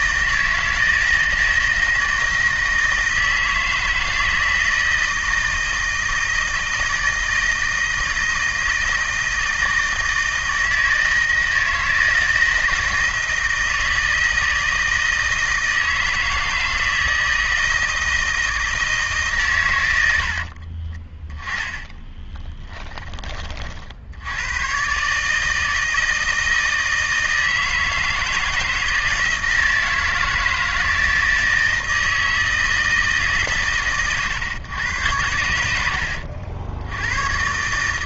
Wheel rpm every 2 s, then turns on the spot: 160, 160, 160, 160, 160, 160, 160, 160, 160, 160, 30, 10, 130, 160, 160, 160, 160, 100, 90.
20-24